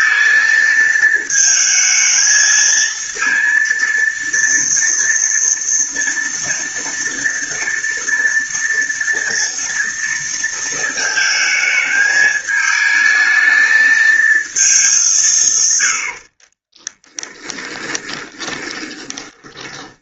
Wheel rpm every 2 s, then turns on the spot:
230, 220, 230, 230, 230, 230, 220, 220, 40, 20.
16-20